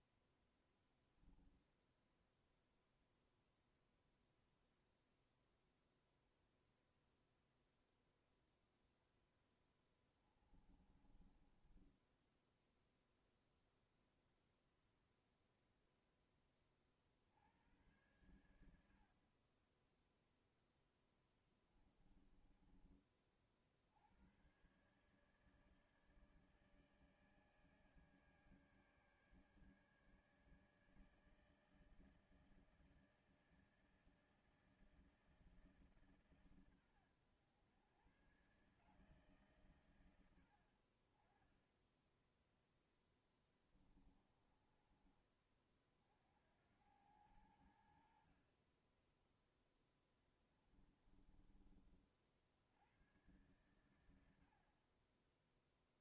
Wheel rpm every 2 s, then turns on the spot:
0, 0, 0, 0, 0, 20, 10, 0, 10, 80, 10, 20, 90, 150, 150, 150, 160, 160, 140, 120, 100, 10, 20, 60, 60, 20, 50, 80.
10-14 22-24 42-46 50-52 54-56